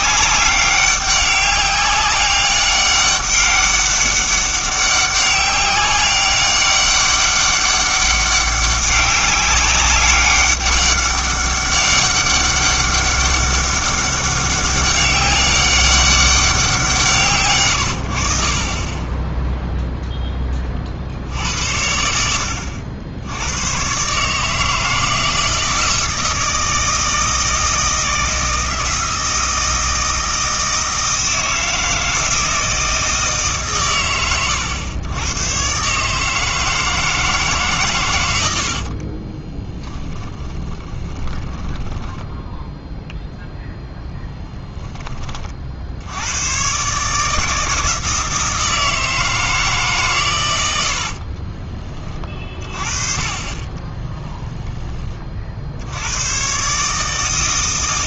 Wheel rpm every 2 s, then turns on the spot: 200, 200, 200, 200, 200, 200, 200, 200, 180, 40, 30, 70, 160, 160, 160, 160, 160, 110, 160, 70, 30, 0, 10, 120, 160, 90, 30, 10, 130.
38-42 54-56